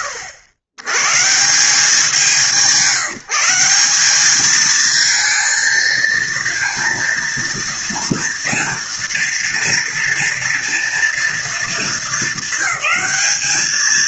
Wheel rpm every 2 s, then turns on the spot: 100, 160, 220, 230, 230, 230, 210.
none